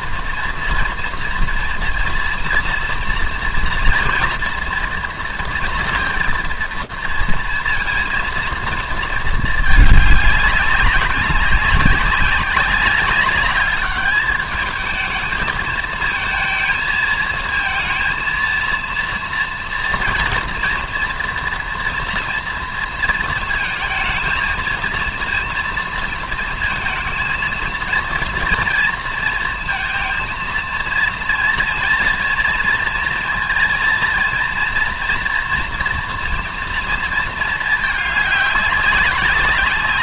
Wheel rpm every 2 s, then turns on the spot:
230, 230, 230, 230, 230, 200, 190, 210, 220, 230, 230, 230, 220, 230, 230, 230, 230, 230, 230, 200.
none